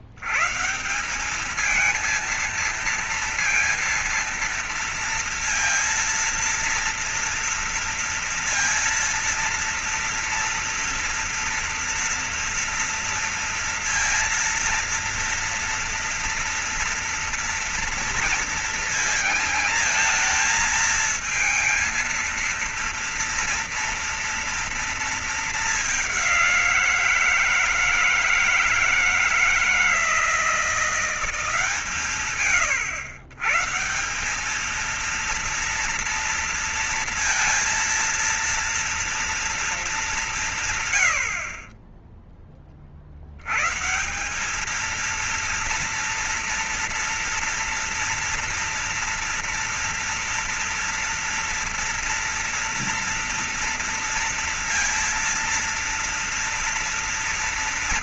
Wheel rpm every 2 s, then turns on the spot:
90, 220, 230, 230, 230, 230, 230, 230, 230, 230, 230, 230, 230, 200, 160, 160, 140, 180, 230, 230, 200, 20, 170, 230, 230, 230, 230, 240, 230.
none